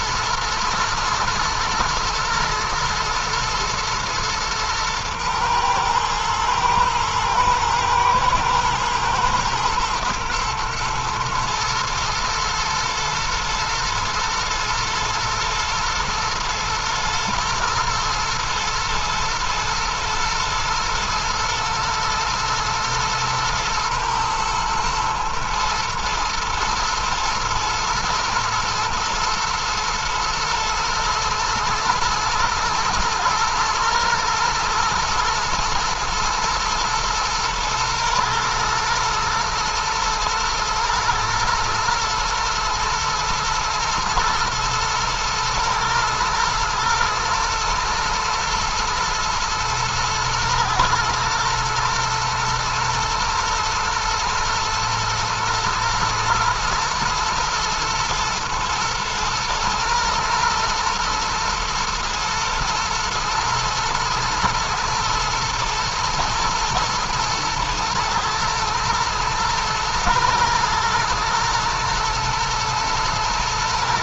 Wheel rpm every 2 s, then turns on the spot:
110, 110, 110, 110, 110, 110, 110, 110, 110, 110, 110, 110, 120, 110, 120, 120, 110, 110, 110, 110, 110, 110, 110, 110, 120, 110, 120, 110, 120, 120, 120, 110, 110, 110, 110, 110, 110.
none